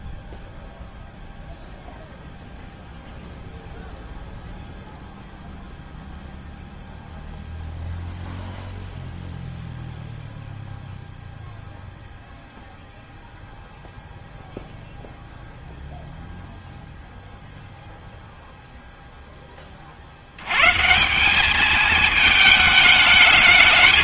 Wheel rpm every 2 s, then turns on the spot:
0, 0, 0, 0, 0, 0, 0, 0, 0, 0, 120, 220.
none